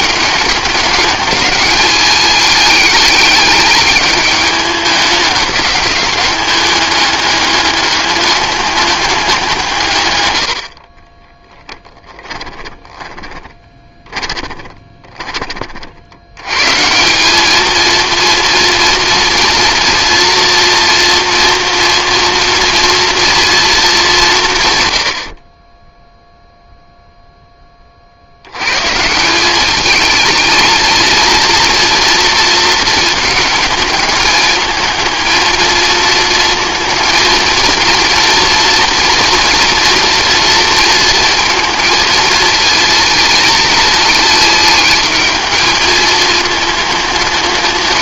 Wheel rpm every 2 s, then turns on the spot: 210, 210, 210, 200, 200, 40, 20, 20, 160, 230, 240, 240, 100, 0, 140, 230, 220, 220, 230, 230, 230, 230, 220, 210.
10-16